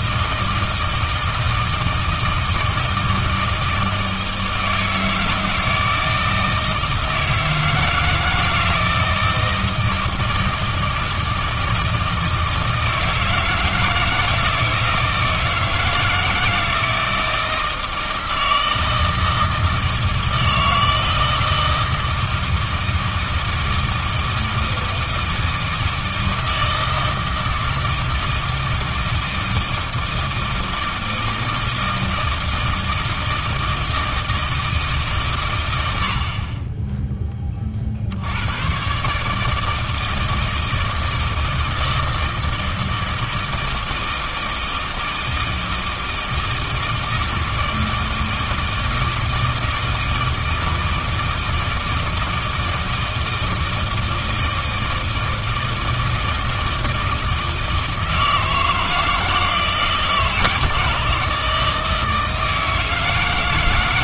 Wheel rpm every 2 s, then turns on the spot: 160, 160, 160, 160, 160, 160, 160, 160, 160, 160, 160, 160, 160, 160, 160, 160, 160, 150, 20, 110, 160, 160, 160, 160, 160, 160, 160, 160, 160, 160, 160, 160.
none